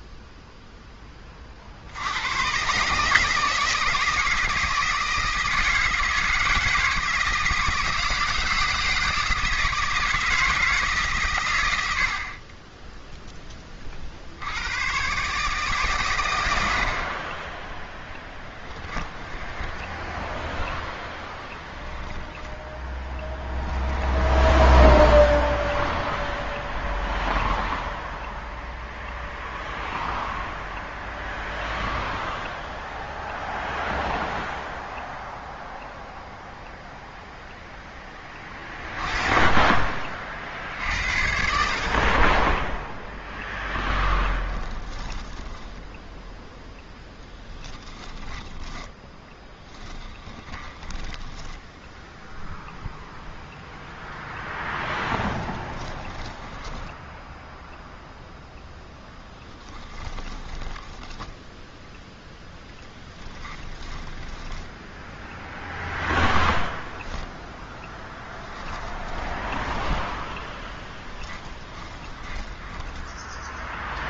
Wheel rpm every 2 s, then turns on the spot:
10, 150, 160, 160, 160, 150, 10, 110, 70, 10, 0, 10, 10, 0, 0, 0, 0, 0, 0, 20, 60, 10, 20, 10, 20, 10, 0, 0, 10, 0, 10, 10, 10, 0, 20, 10, 10.
18-20 24-26 44-46 48-50 56-58 60-66 68-74